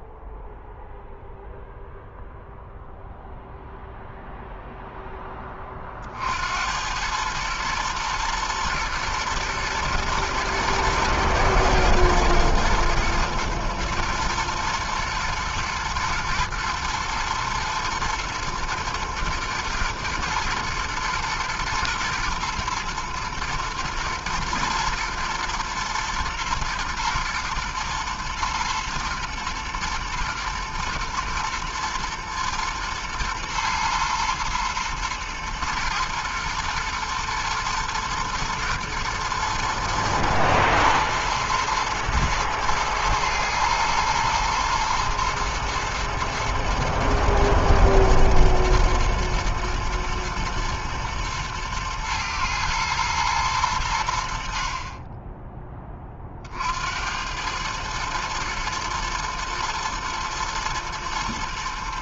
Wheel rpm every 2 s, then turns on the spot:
0, 0, 0, 60, 120, 120, 110, 120, 110, 120, 120, 120, 110, 110, 120, 110, 120, 120, 120, 120, 120, 120, 110, 110, 110, 110, 110, 60, 40, 110, 110.
none